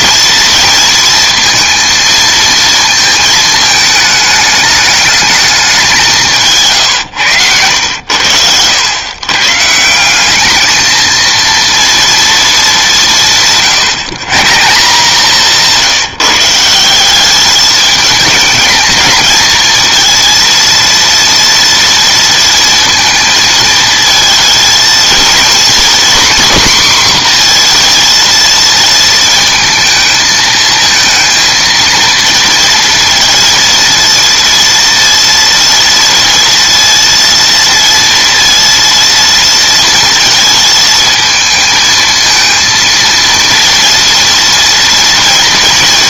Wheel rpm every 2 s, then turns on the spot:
230, 230, 210, 110, 120, 230, 180, 170, 180, 220, 230, 230, 230, 250, 230, 230, 230, 230, 230, 230, 220, 230, 240.
none